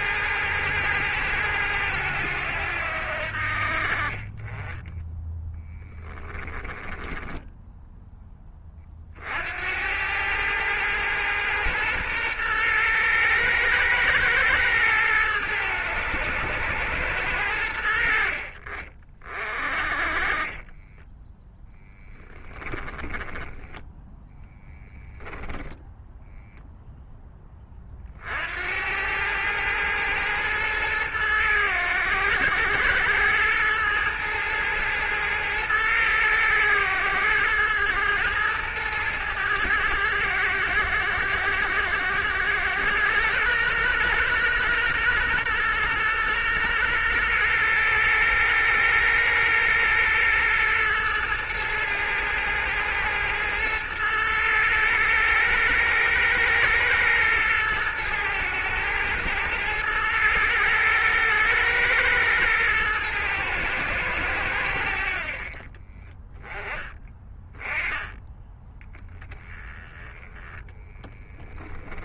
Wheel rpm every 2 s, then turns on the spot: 110, 90, 20, 10, 30, 110, 110, 110, 100, 40, 20, 10, 10, 0, 80, 110, 100, 110, 110, 110, 100, 110, 120, 120, 110, 120, 110, 110, 110, 110, 110, 110, 80, 10, 10, 30.
6-8 20-26 70-72